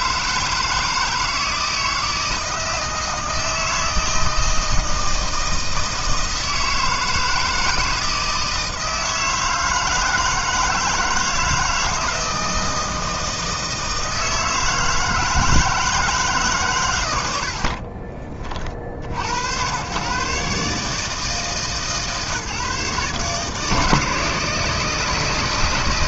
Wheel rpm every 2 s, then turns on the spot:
160, 160, 160, 160, 160, 160, 160, 160, 120, 50, 150, 150, 160.
none